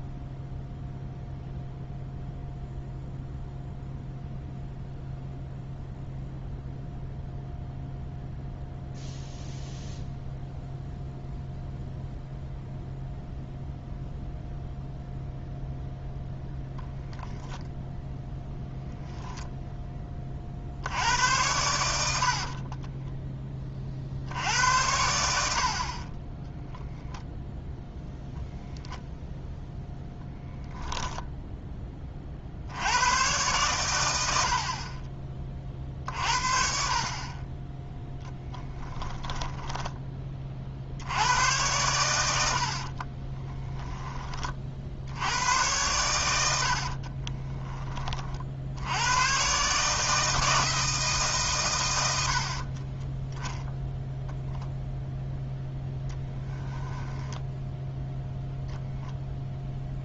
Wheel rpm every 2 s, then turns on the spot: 0, 0, 0, 0, 0, 0, 0, 0, 0, 0, 60, 40, 80, 0, 0, 0, 70, 50, 50, 10, 50, 70, 50, 80, 70, 160, 40, 0, 10, 0.
22-24 38-40 46-48 52-54 56-58